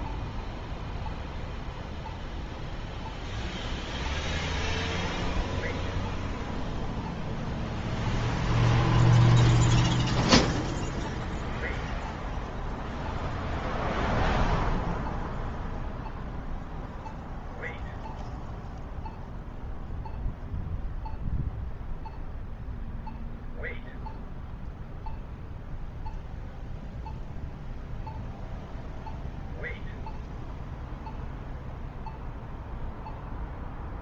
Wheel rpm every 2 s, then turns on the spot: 0, 0, 0, 0, 0, 0, 0, 0, 0, 0, 0, 0, 0, 0, 0, 0, 0.
none